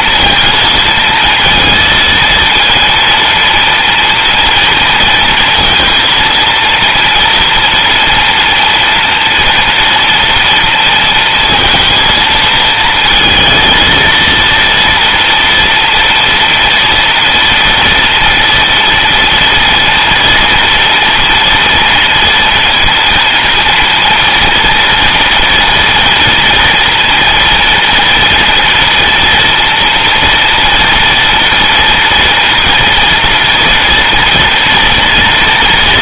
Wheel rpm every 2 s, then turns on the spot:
230, 230, 230, 230, 230, 230, 230, 230, 230, 230, 240, 230, 230, 230, 230, 230, 230, 230.
none